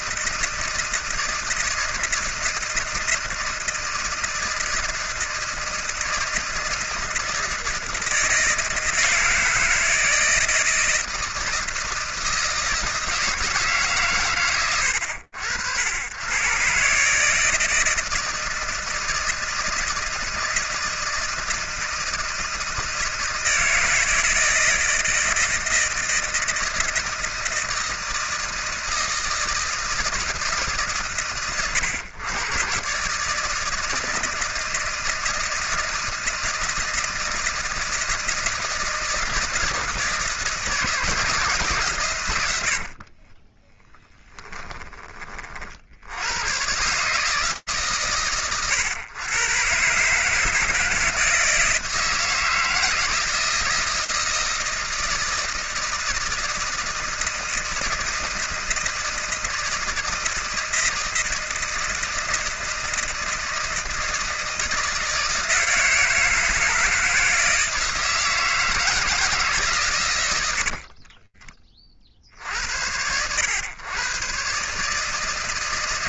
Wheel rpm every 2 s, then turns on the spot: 160, 160, 160, 160, 160, 160, 160, 100, 110, 160, 160, 160, 160, 160, 160, 150, 120, 160, 170, 160, 160, 110, 10, 80, 120, 150, 160, 160, 160, 160, 160, 160, 160, 160, 160, 140, 50, 130.
44-46